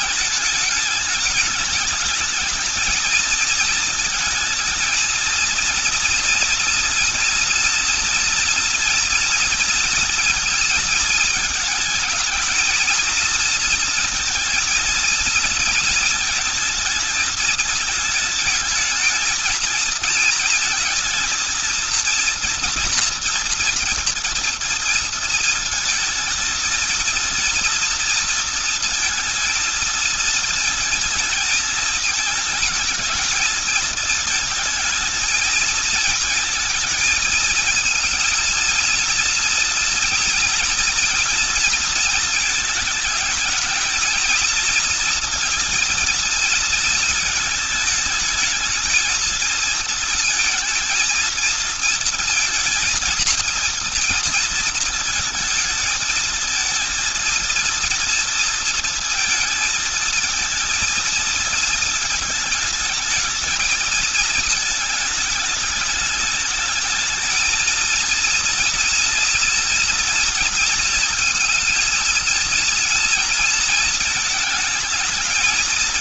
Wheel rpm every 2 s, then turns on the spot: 210, 220, 230, 230, 230, 230, 230, 230, 220, 220, 220, 230, 220, 230, 230, 220, 220, 220, 220, 230, 230, 220, 230, 220, 220, 230, 220, 220, 230, 230, 230, 220, 220, 220, 230, 230, 230, 220.
none